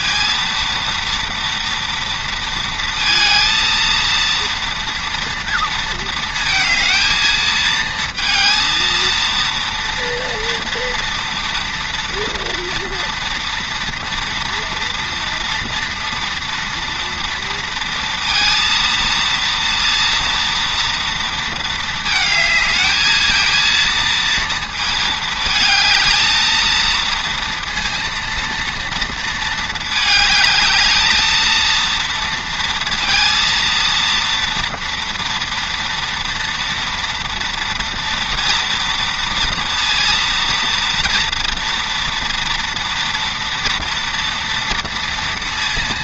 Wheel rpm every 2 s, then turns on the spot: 230, 230, 230, 230, 230, 230, 230, 230, 230, 230, 230, 220, 230, 230, 230, 220, 230, 230, 230, 230, 230, 230, 230.
none